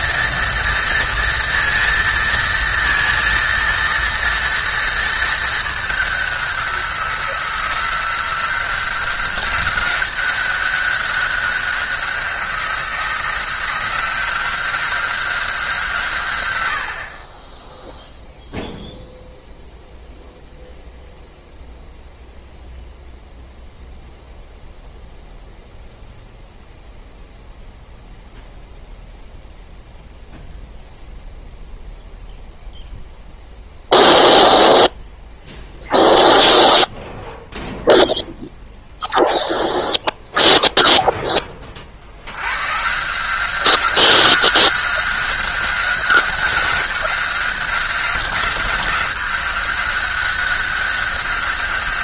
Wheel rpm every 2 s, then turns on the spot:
230, 230, 230, 180, 180, 190, 180, 180, 80, 0, 0, 0, 0, 0, 0, 0, 0, 0, 0, 0, 0, 120, 190, 190, 190, 190.
none